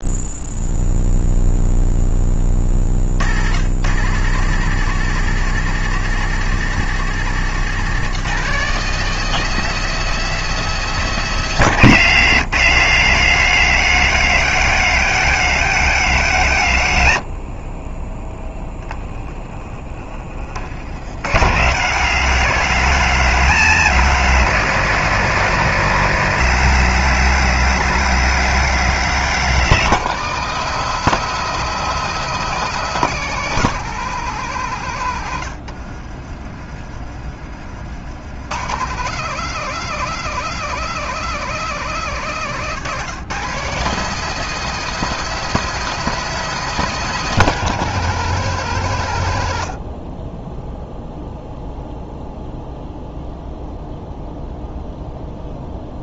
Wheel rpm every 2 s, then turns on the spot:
0, 50, 160, 170, 180, 180, 130, 150, 80, 10, 70, 150, 150, 140, 140, 200, 190, 130, 30, 130, 170, 150, 200, 190, 130, 0, 0, 0.
none